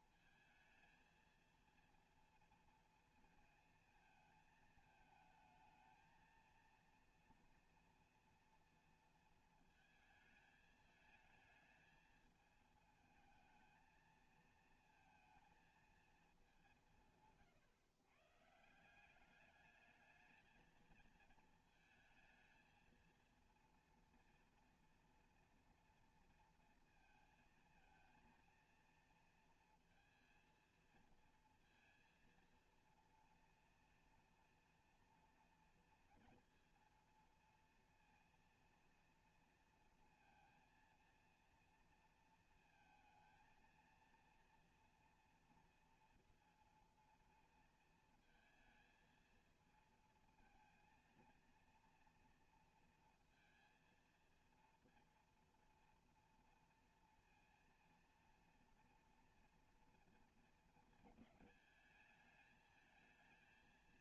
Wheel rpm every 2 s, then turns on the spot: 220, 230, 220, 230, 230, 220, 220, 220, 190, 150, 220, 220, 230, 230, 230, 230, 230, 230, 230, 230, 230, 230, 230, 230, 230, 230, 230, 230, 230, 230, 230, 220.
none